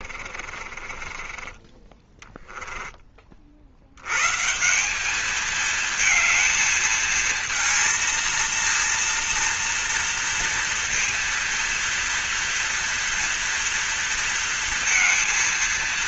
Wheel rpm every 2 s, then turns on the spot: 40, 20, 190, 220, 230, 230, 230, 230.
0-2